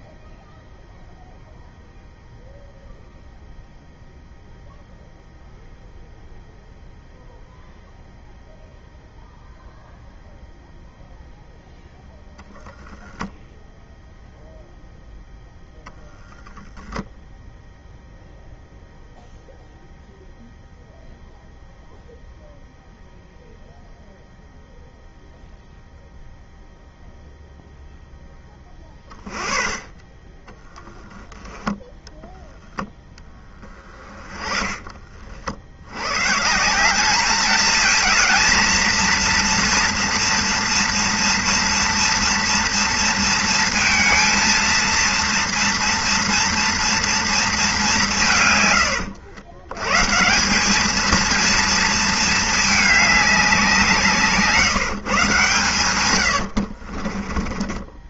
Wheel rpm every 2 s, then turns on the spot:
0, 0, 0, 0, 0, 0, 0, 0, 0, 0, 0, 0, 0, 0, 10, 10, 0, 20, 160, 230, 230, 230, 230, 230, 130, 190, 220, 150, 60.
56-58